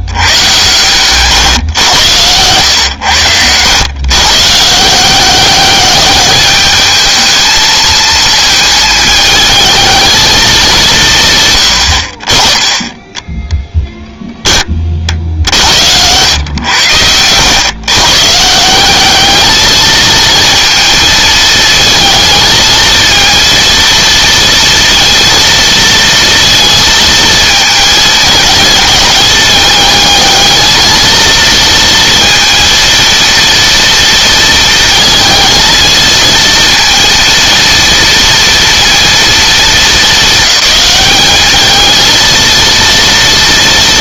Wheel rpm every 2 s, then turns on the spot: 130, 110, 160, 210, 220, 160, 10, 40, 100, 190, 230, 230, 230, 230, 220, 220, 230, 220, 230, 230, 210, 230.
none